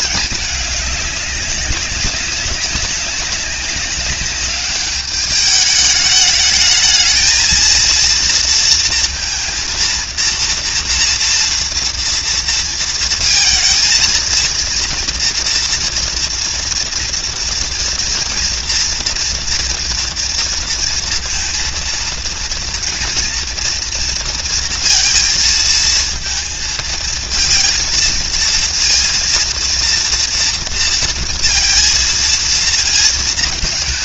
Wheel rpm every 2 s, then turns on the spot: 200, 200, 210, 230, 230, 230, 230, 230, 230, 230, 230, 230, 230, 220, 240, 230, 220.
none